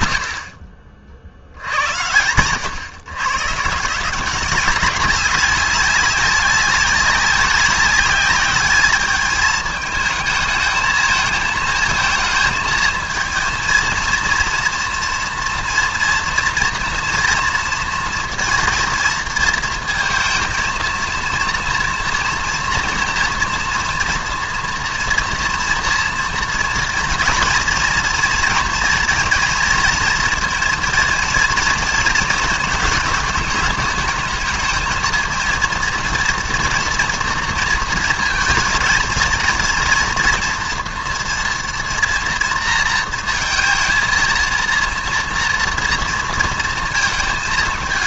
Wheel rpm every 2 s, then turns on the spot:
30, 100, 190, 190, 210, 220, 230, 230, 230, 230, 230, 230, 230, 230, 230, 230, 220, 220, 230, 230, 230, 230, 230, 230.
none